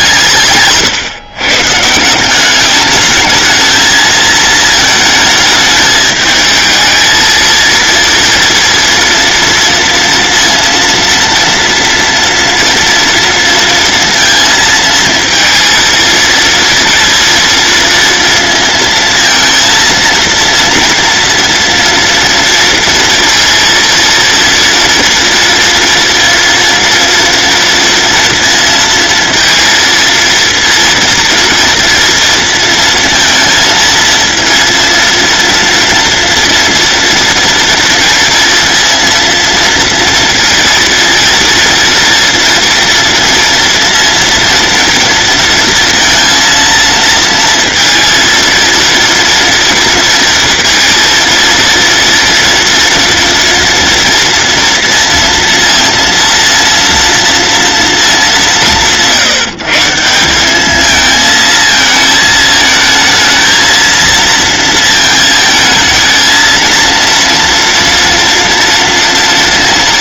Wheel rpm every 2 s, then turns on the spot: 140, 210, 220, 220, 230, 230, 230, 230, 230, 230, 230, 230, 230, 230, 220, 230, 230, 230, 230, 230, 230, 230, 230, 230, 230, 230, 240, 230, 230, 160, 220, 220, 220, 230, 230.
none